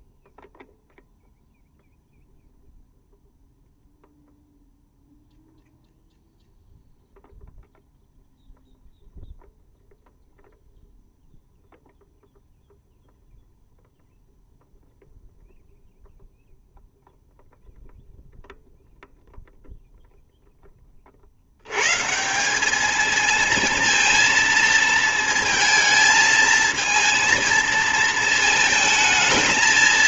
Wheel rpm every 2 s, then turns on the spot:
0, 0, 0, 0, 0, 0, 0, 0, 0, 0, 20, 210, 230, 220, 220.
none